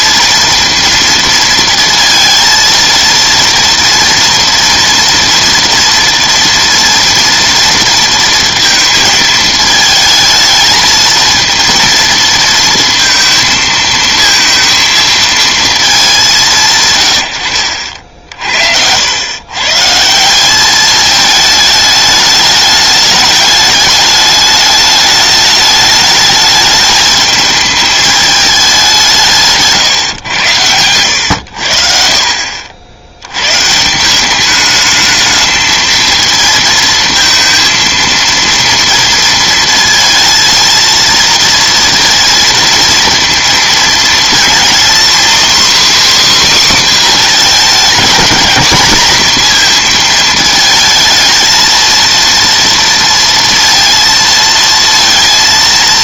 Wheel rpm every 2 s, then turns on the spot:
230, 230, 230, 230, 230, 220, 230, 230, 130, 70, 200, 210, 210, 220, 190, 100, 60, 210, 230, 230, 230, 230, 240, 270, 230, 220, 230, 230.
none